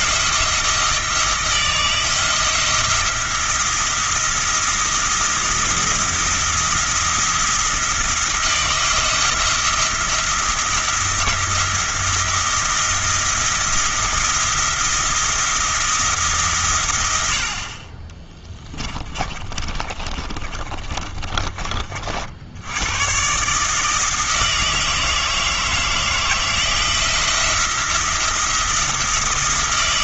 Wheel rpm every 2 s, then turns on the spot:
160, 170, 170, 170, 170, 170, 170, 170, 110, 20, 30, 110, 160, 170, 170.
18-22